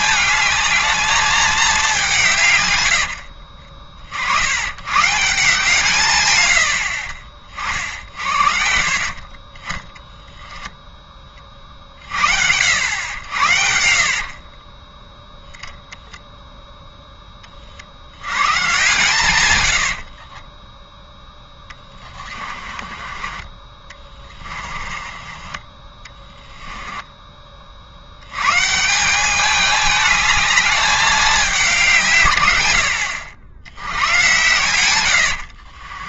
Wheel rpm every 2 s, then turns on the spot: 220, 80, 130, 50, 50, 10, 90, 10, 10, 130, 10, 30, 30, 20, 180, 200, 80, 80.
2-4 12-14 20-28 34-36